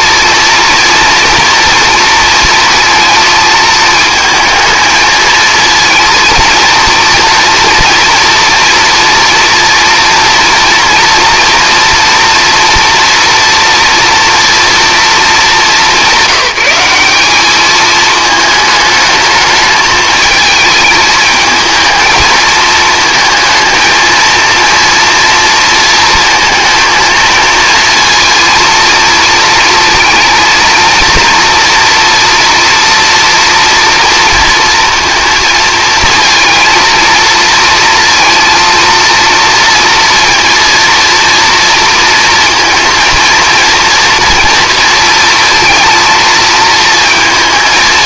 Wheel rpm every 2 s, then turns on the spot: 230, 230, 220, 230, 230, 230, 240, 240, 190, 220, 220, 220, 230, 230, 230, 230, 240, 230, 230, 230, 230, 230, 240, 230.
none